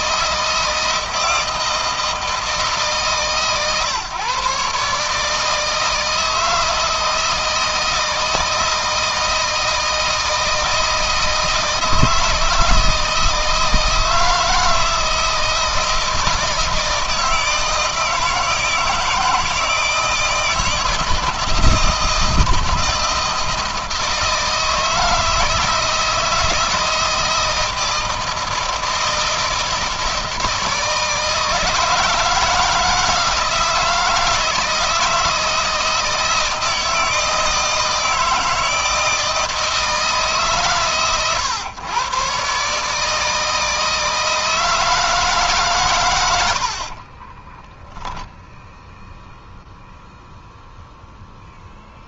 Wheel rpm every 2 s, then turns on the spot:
160, 150, 150, 160, 160, 160, 160, 170, 160, 160, 160, 160, 160, 160, 160, 160, 160, 160, 160, 160, 140, 150, 160, 40, 0, 0.
46-48